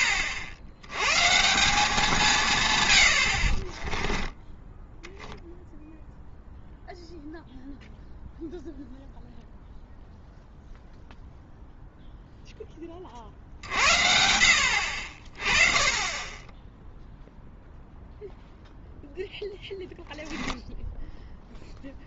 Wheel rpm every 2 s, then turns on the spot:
80, 130, 10, 0, 0, 0, 10, 70, 10, 0, 0.
none